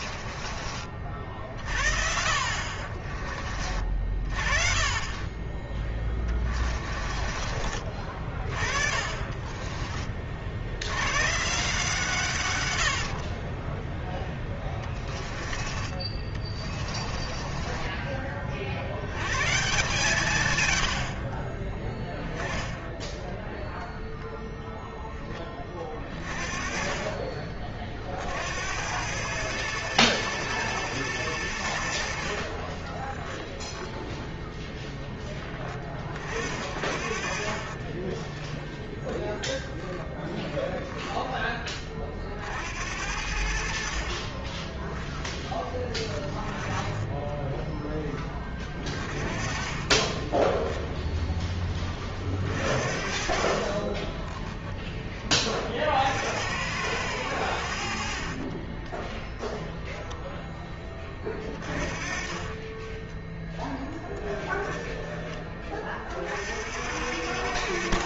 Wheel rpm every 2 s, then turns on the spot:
40, 50, 20, 40, 40, 100, 80, 20, 30, 90, 80, 10, 10, 30, 100, 110, 20, 10, 40, 0, 10, 70, 10, 10, 30, 10, 40, 10, 90, 10, 20, 20, 20, 80.
2-4 6-10 12-14 16-18 22-24 36-38 46-48 58-60 62-64